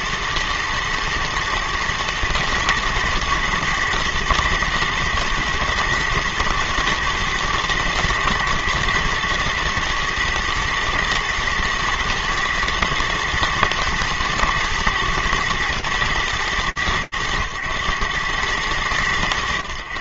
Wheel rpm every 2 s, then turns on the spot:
110, 110, 110, 110, 110, 120, 110, 110, 110, 100.
none